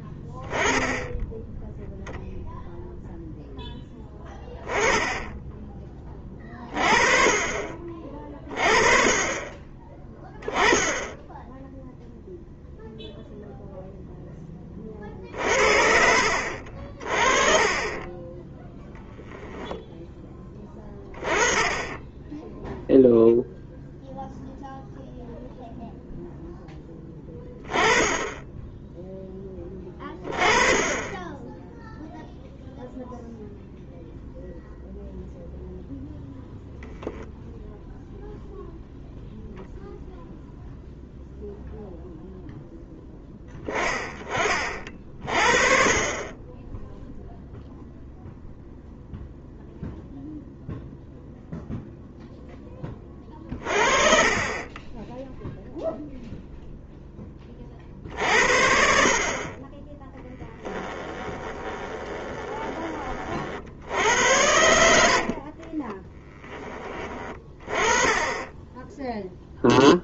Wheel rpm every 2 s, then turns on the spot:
10, 0, 20, 30, 30, 10, 0, 20, 50, 10, 10, 0, 0, 10, 10, 20, 0, 0, 0, 0, 0, 10, 40, 10, 0, 0, 10, 30, 0, 50, 10, 20, 80, 20, 20.
60-62 64-66